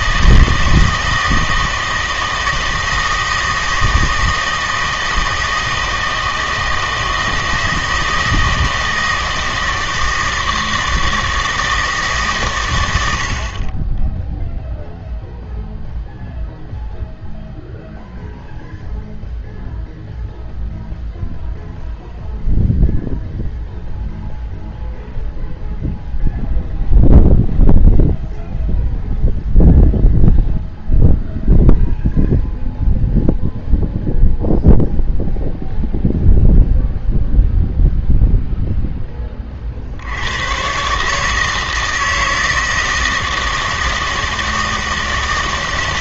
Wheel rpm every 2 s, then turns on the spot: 160, 160, 160, 160, 160, 160, 110, 0, 0, 0, 0, 0, 0, 0, 0, 0, 0, 0, 0, 0, 130, 160, 160.
none